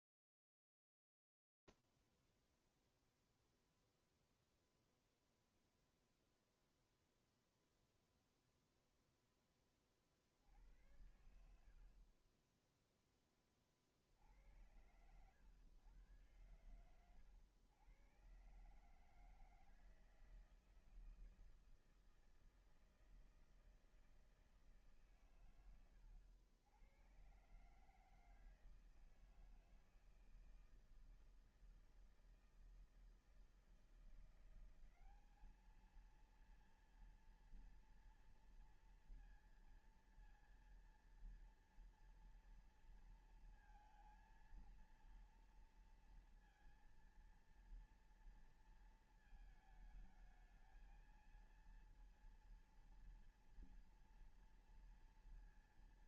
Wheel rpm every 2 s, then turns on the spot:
0, 0, 0, 0, 0, 50, 30, 70, 110, 110, 160, 160, 160, 100, 160, 160, 160, 180, 230, 230, 230, 230, 230, 230, 230, 220, 230, 230.
none